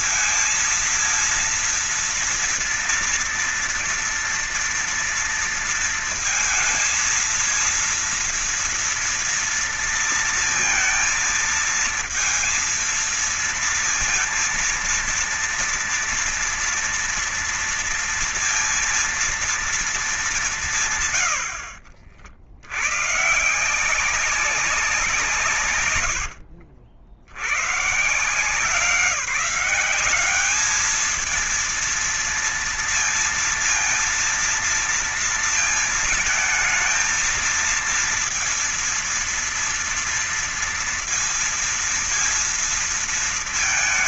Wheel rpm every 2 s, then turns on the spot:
220, 230, 230, 230, 230, 230, 230, 230, 230, 230, 200, 80, 190, 80, 160, 200, 230, 230, 230, 230, 230, 230.
26-28